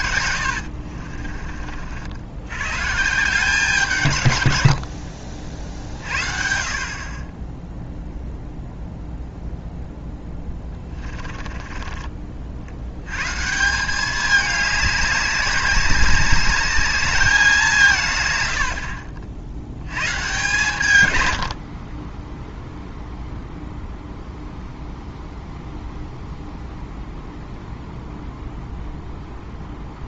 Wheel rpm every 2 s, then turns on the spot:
60, 120, 80, 40, 0, 20, 70, 210, 200, 90, 130, 0, 0, 0, 0.
0-2 10-12